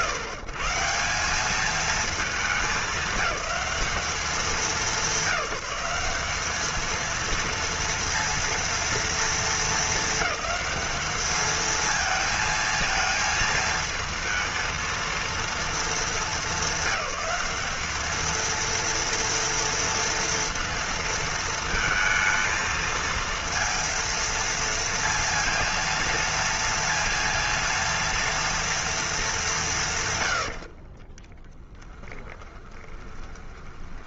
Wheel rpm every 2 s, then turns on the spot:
140, 200, 200, 220, 230, 210, 220, 230, 210, 230, 230, 230, 230, 230, 230, 60, 20.
30-34